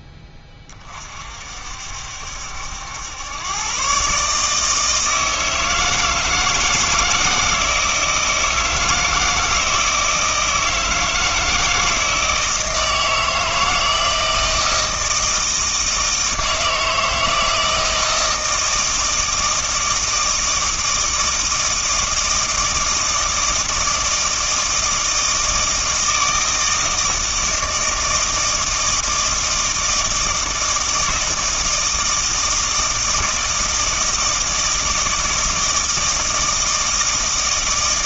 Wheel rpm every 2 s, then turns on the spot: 30, 80, 160, 160, 160, 160, 160, 160, 160, 160, 160, 160, 160, 160, 160, 160, 160, 160, 160.
none